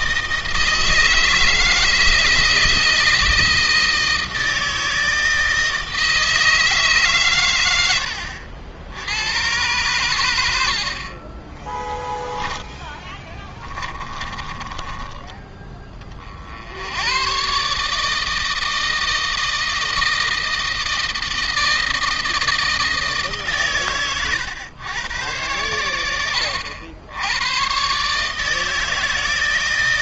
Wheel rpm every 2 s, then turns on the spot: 160, 160, 160, 140, 80, 60, 10, 40, 90, 160, 160, 160, 110, 80, 160.
12-14